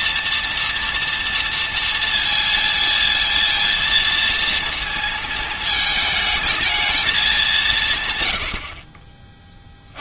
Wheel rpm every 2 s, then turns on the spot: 230, 230, 230, 220, 40.
none